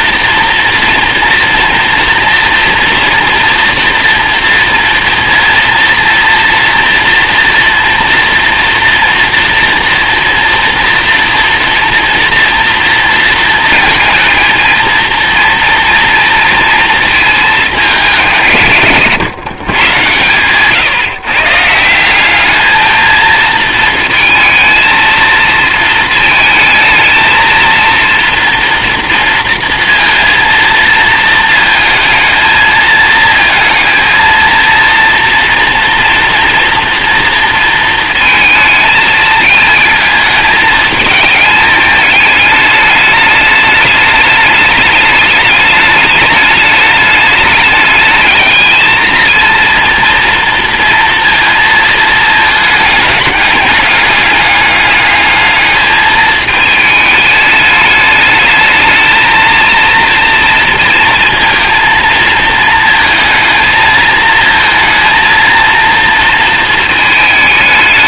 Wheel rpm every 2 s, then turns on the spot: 240, 230, 230, 240, 230, 230, 230, 230, 230, 130, 140, 220, 230, 220, 230, 230, 220, 230, 240, 220, 220, 210, 210, 210, 220, 230, 210, 210, 220, 220, 230, 220, 230, 220.
none